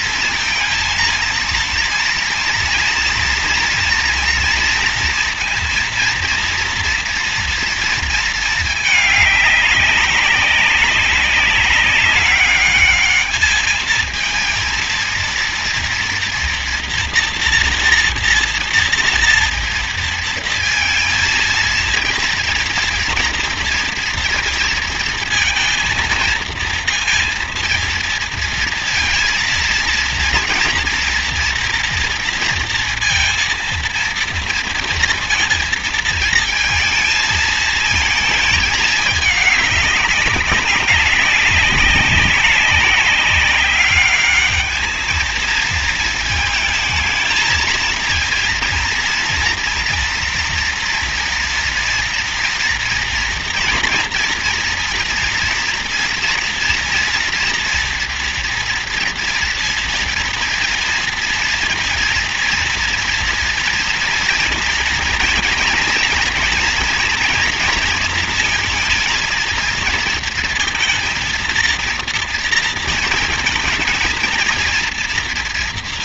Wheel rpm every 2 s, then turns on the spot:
230, 230, 230, 230, 210, 190, 210, 230, 230, 230, 230, 230, 230, 230, 230, 230, 230, 230, 230, 220, 190, 200, 210, 220, 230, 230, 230, 240, 230, 240, 230, 230, 230, 230, 230, 230, 230, 230.
none